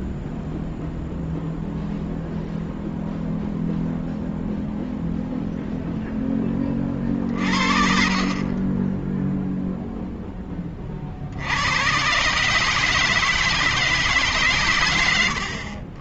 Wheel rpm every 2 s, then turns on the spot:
0, 0, 0, 10, 20, 20, 150, 140.
8-10